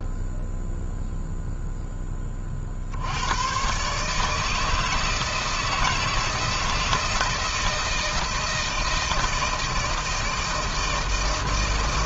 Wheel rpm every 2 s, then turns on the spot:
0, 40, 150, 160, 160, 160.
none